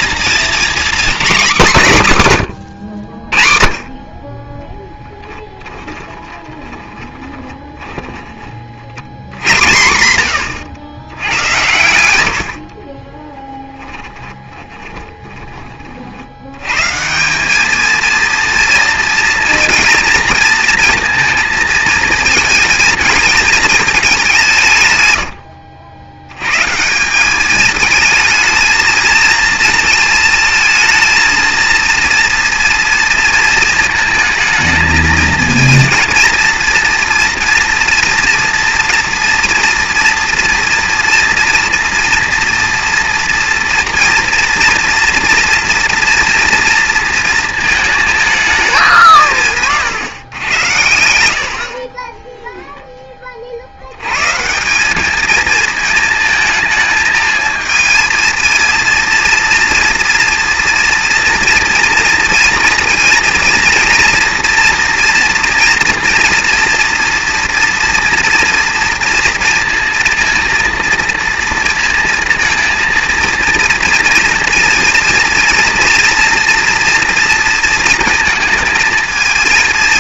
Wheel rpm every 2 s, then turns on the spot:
240, 130, 10, 20, 40, 100, 40, 20, 100, 230, 230, 220, 160, 140, 220, 220, 230, 230, 230, 230, 230, 230, 230, 230, 200, 100, 10, 170, 220, 230, 230, 230, 240, 230, 230, 230, 230, 230, 230, 230.
6-8 12-16